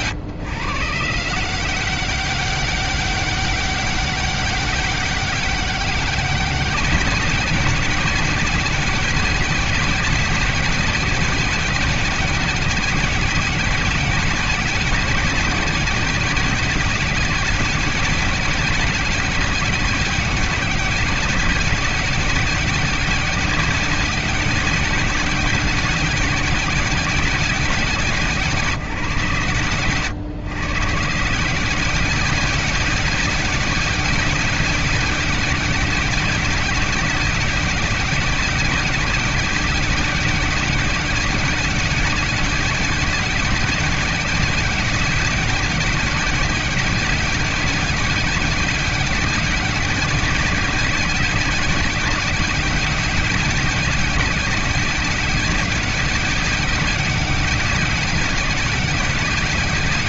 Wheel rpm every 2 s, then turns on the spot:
140, 200, 200, 200, 190, 190, 190, 190, 190, 190, 190, 190, 190, 200, 180, 140, 190, 190, 190, 190, 190, 200, 190, 190, 190, 190, 190, 190, 190, 190.
none